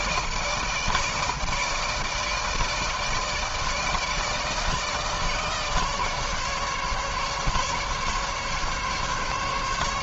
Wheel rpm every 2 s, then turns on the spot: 160, 160, 160, 150, 140.
none